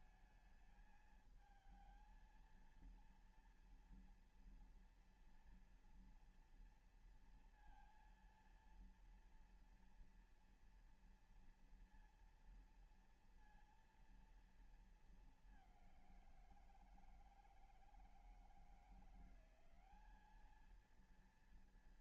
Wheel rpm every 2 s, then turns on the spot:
220, 230, 230, 230, 230, 230, 230, 220, 170, 170, 220.
none